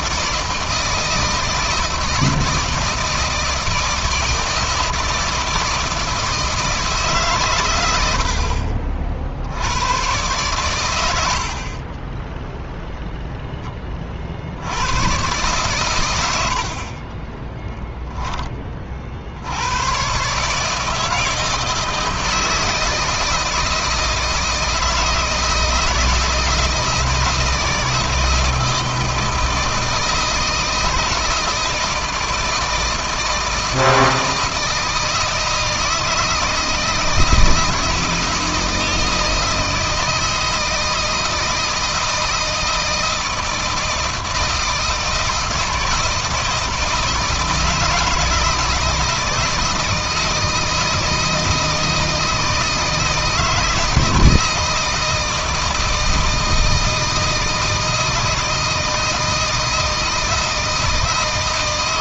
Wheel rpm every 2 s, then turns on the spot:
160, 160, 160, 150, 50, 110, 0, 110, 30, 40, 160, 160, 160, 160, 160, 160, 160, 160, 170, 160, 160, 160, 160, 160, 160, 160, 160, 160, 160, 160, 160.
16-18